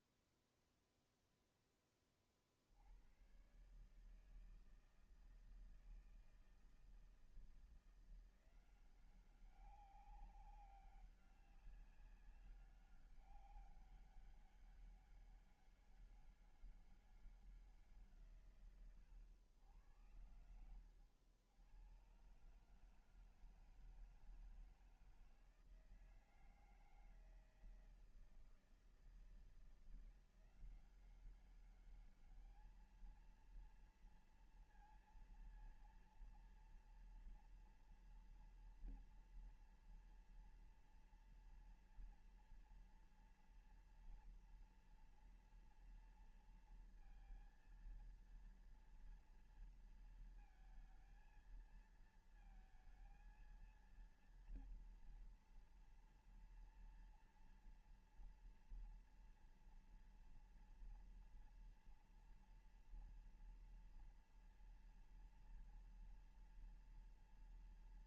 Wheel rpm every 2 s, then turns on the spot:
0, 40, 160, 160, 170, 200, 200, 200, 200, 150, 90, 120, 160, 160, 160, 180, 210, 230, 230, 230, 230, 230, 230, 230, 230, 230, 230, 230, 230, 230, 230, 240, 230, 230.
20-22